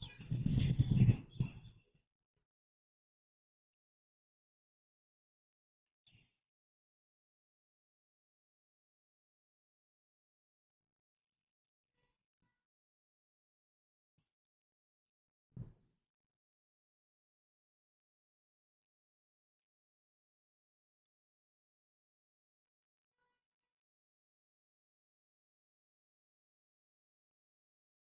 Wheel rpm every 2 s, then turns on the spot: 0, 0, 0, 0, 0, 0, 0, 0, 0, 0, 0, 0, 0, 0.
none